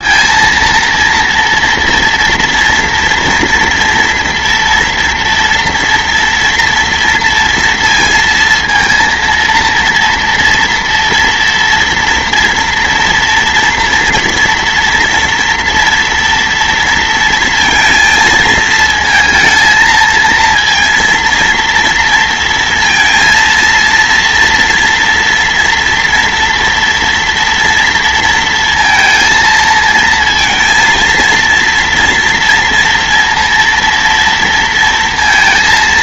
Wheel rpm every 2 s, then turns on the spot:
230, 230, 230, 230, 230, 230, 230, 230, 230, 230, 230, 230, 230, 240, 230, 230, 230, 230.
none